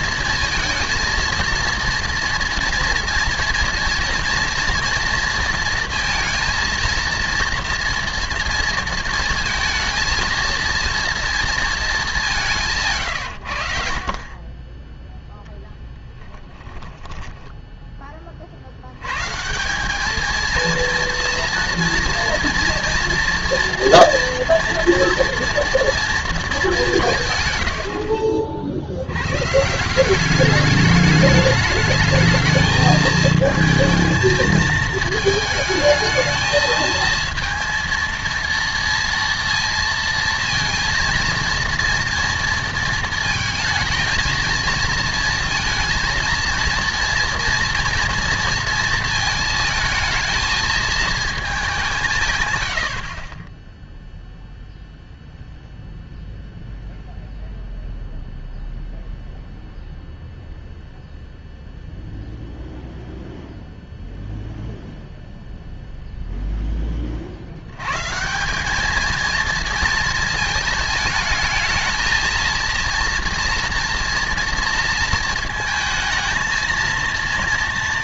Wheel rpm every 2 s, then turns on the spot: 230, 240, 240, 230, 230, 230, 170, 20, 10, 60, 230, 240, 230, 220, 70, 200, 220, 220, 220, 230, 230, 230, 220, 230, 230, 220, 110, 0, 0, 0, 0, 0, 0, 10, 200, 220, 230, 230, 220.
16-18